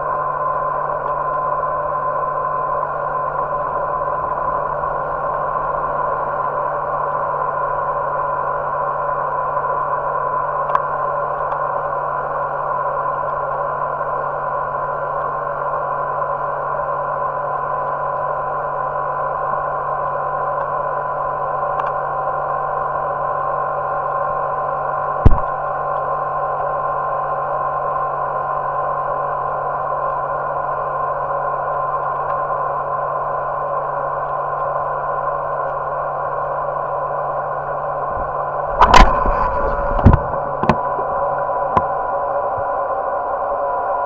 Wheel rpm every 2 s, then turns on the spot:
0, 0, 0, 0, 0, 0, 0, 0, 0, 0, 0, 0, 0, 0, 0, 0, 0, 0, 0, 0, 0, 0.
none